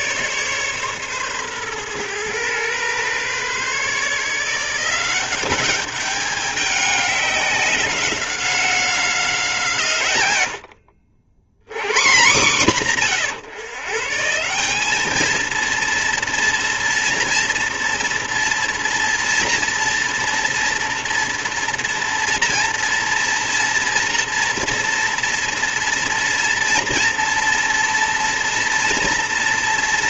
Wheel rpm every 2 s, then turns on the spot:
140, 120, 170, 200, 180, 70, 150, 200, 230, 230, 230, 240, 230, 230, 230.
none